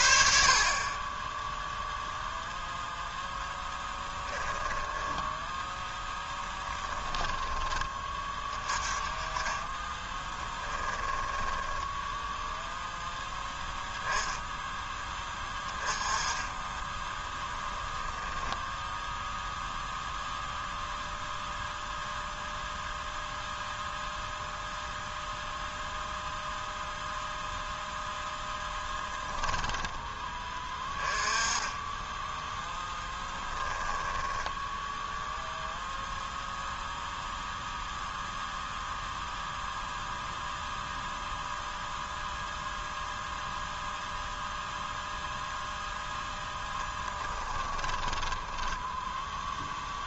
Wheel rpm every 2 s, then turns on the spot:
50, 0, 20, 20, 20, 10, 0, 0, 20, 0, 0, 0, 0, 0, 0, 20, 10, 10, 0, 0, 0, 0, 0, 0, 10.
4-8 10-12 34-36